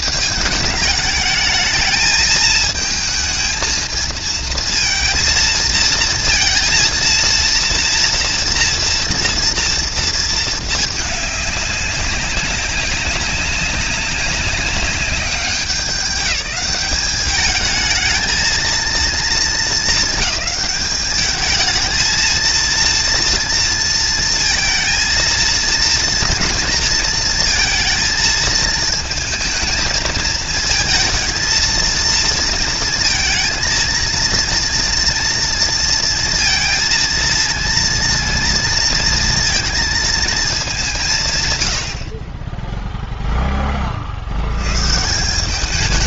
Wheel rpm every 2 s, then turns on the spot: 210, 220, 230, 230, 230, 210, 190, 200, 210, 230, 210, 230, 230, 230, 220, 220, 230, 230, 230, 230, 170, 0, 160.
none